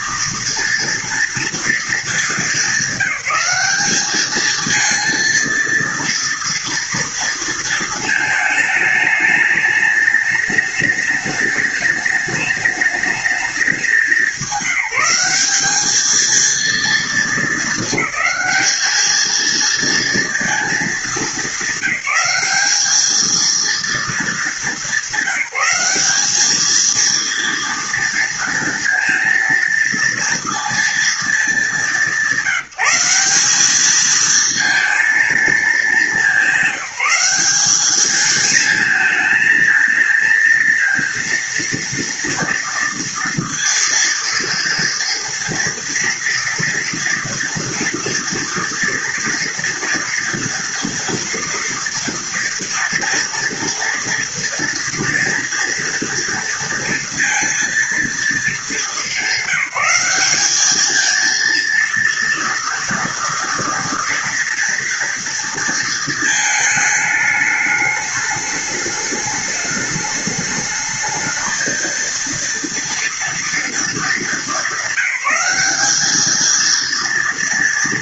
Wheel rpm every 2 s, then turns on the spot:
230, 210, 220, 230, 220, 210, 210, 190, 220, 220, 220, 210, 200, 220, 230, 230, 180, 230, 200, 220, 230, 230, 230, 230, 230, 230, 230, 230, 230, 220, 220, 230, 230, 220, 210, 210, 230, 200, 230.
none